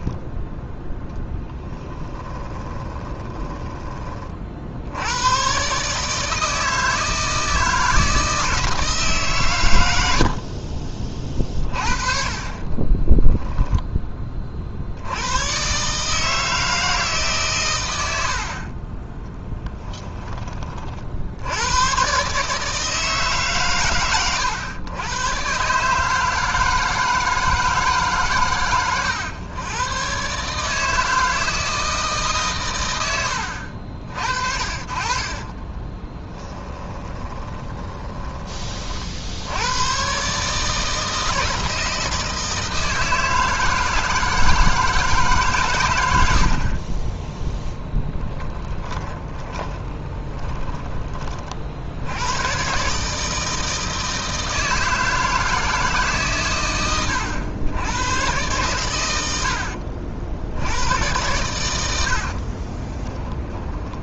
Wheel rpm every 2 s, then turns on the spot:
0, 20, 80, 160, 160, 40, 30, 50, 160, 30, 40, 150, 110, 160, 100, 160, 130, 50, 20, 40, 160, 160, 160, 30, 20, 20, 140, 160, 110, 100, 90, 20.
2-4 12-14 36-38 48-50 62-64